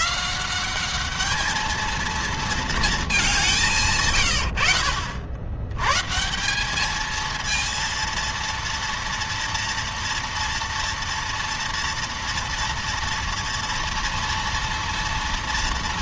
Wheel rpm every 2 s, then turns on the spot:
190, 220, 70, 190, 230, 230, 230, 230.
none